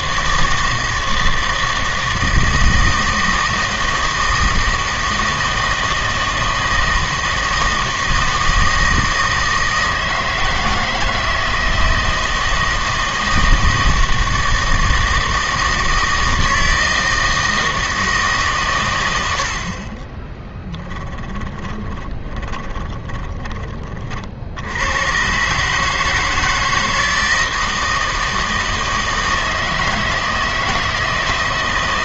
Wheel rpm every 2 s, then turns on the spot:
160, 160, 160, 160, 160, 160, 160, 160, 160, 130, 10, 20, 80, 160, 160, 160.
20-24